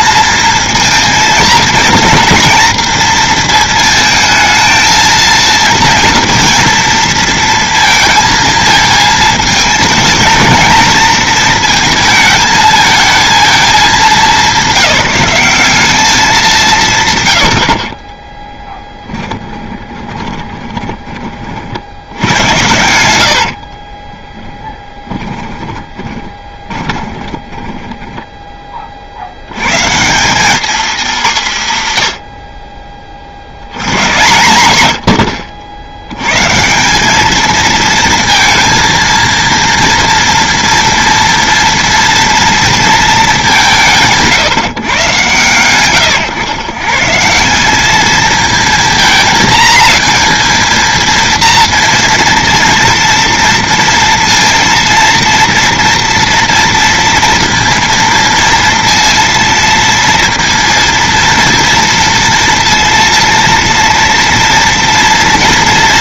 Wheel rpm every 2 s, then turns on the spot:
230, 230, 220, 230, 220, 220, 220, 190, 170, 10, 20, 80, 10, 20, 20, 220, 40, 100, 170, 230, 240, 230, 140, 140, 230, 230, 230, 230, 230, 230, 230, 230, 240.
18-28